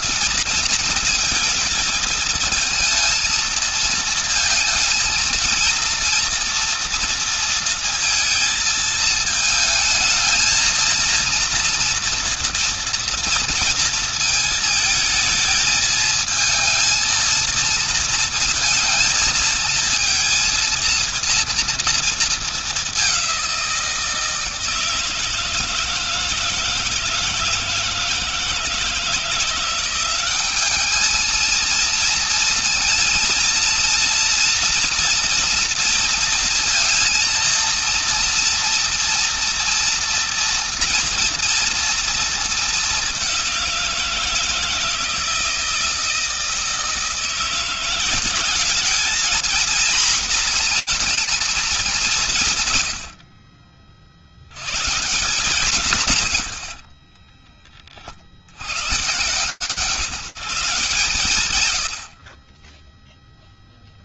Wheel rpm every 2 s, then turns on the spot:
230, 230, 230, 230, 220, 230, 230, 220, 230, 230, 230, 200, 160, 160, 170, 220, 230, 230, 230, 230, 240, 200, 160, 170, 230, 230, 50, 130, 40, 140, 140, 0.
56-58